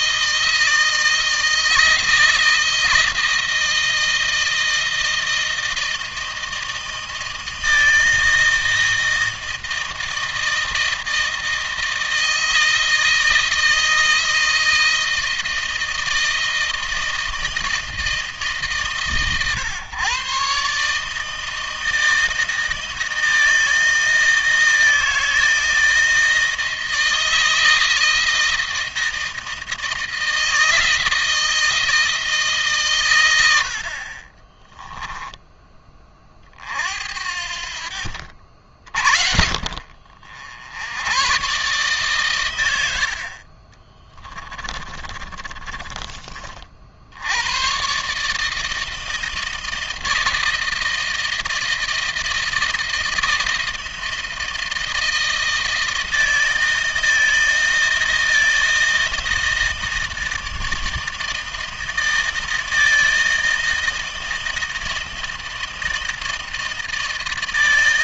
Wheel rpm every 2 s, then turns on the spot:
160, 160, 160, 160, 160, 160, 160, 160, 160, 150, 140, 160, 160, 160, 160, 160, 140, 20, 50, 60, 90, 100, 30, 40, 150, 160, 160, 160, 160, 160, 160, 160, 160, 160.
34-36 44-46